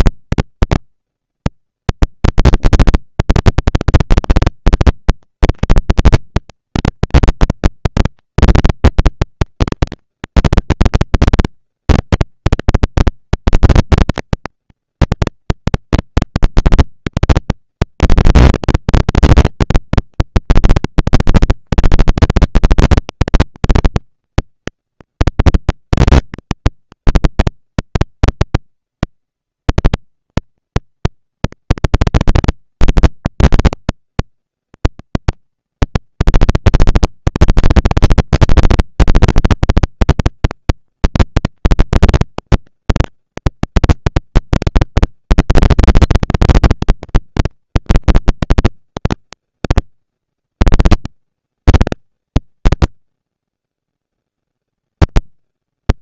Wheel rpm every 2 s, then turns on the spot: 230, 220, 200, 210, 230, 230, 230, 230, 230, 240, 230, 230, 230, 230, 230, 230, 230, 230, 230, 230, 230, 230, 230, 230, 230, 180, 140, 80.
none